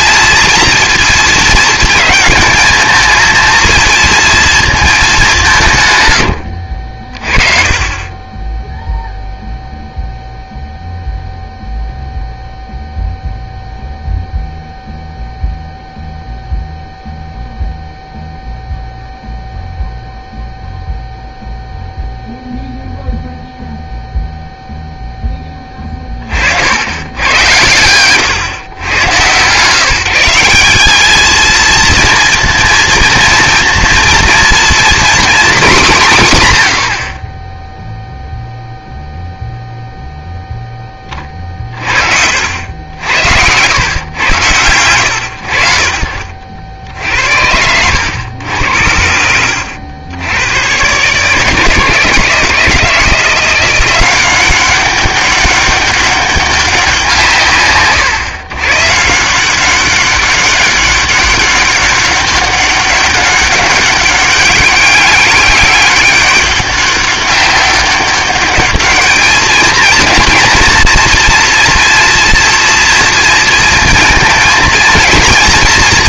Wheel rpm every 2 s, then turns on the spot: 230, 220, 220, 70, 10, 0, 0, 0, 0, 0, 0, 0, 0, 80, 110, 190, 230, 240, 110, 0, 10, 80, 100, 60, 80, 110, 160, 190, 190, 130, 200, 200, 200, 200, 210, 230, 230, 230.
none